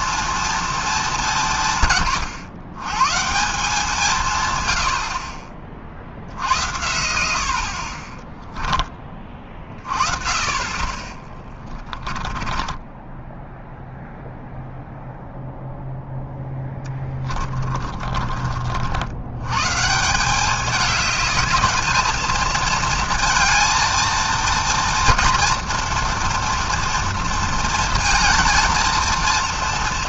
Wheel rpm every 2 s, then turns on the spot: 220, 120, 100, 90, 10, 30, 10, 0, 10, 60, 210, 230, 230, 230, 230.
12-14 16-18